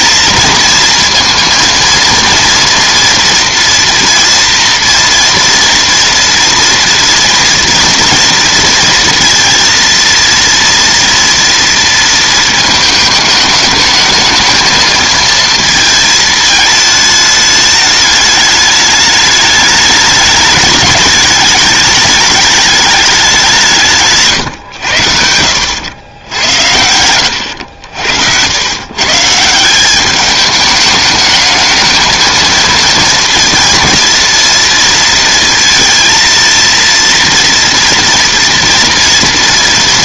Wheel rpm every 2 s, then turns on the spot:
230, 230, 230, 230, 230, 230, 220, 220, 220, 210, 210, 210, 110, 90, 100, 210, 230, 230, 230, 230.
none